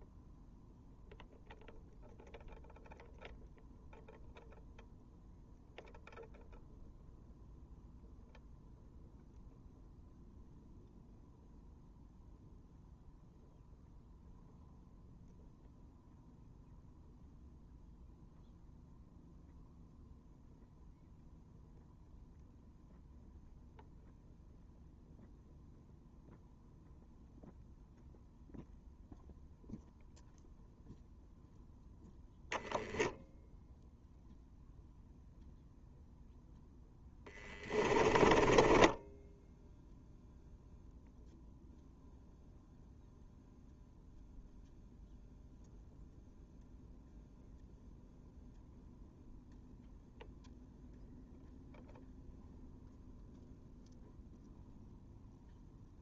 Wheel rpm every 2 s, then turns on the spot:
0, 0, 0, 0, 0, 0, 0, 0, 0, 0, 0, 0, 0, 0, 0, 0, 0, 0, 0, 10, 0, 0, 0, 0, 0, 0, 0, 0.
38-40